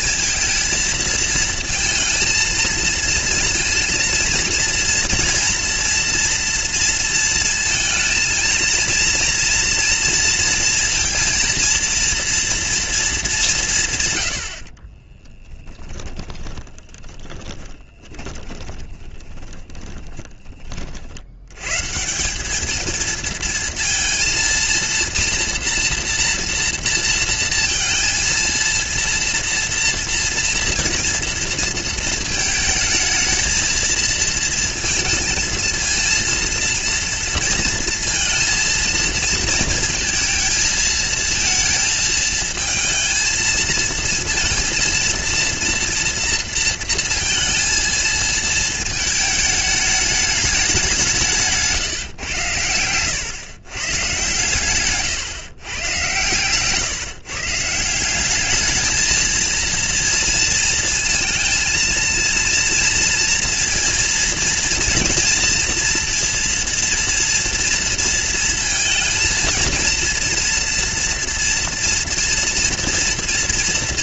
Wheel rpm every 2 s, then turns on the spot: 230, 230, 230, 230, 230, 230, 230, 70, 30, 20, 20, 200, 230, 230, 230, 230, 220, 230, 230, 230, 230, 230, 230, 230, 220, 200, 110, 130, 120, 200, 230, 230, 230, 230, 230, 240, 230.
14-20